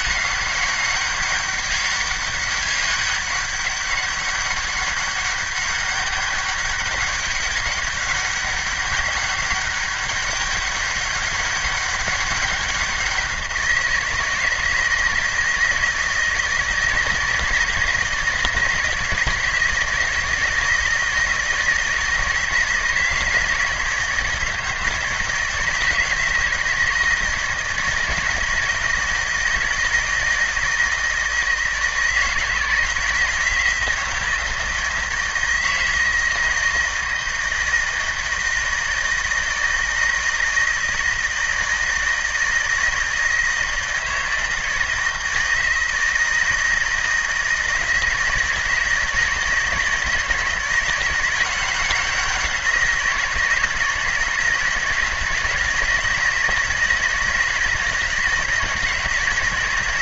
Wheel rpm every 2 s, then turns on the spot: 200, 200, 200, 200, 200, 200, 190, 160, 160, 160, 160, 160, 160, 160, 160, 160, 160, 160, 160, 160, 160, 160, 160, 160, 160, 160, 180, 160, 160, 160.
none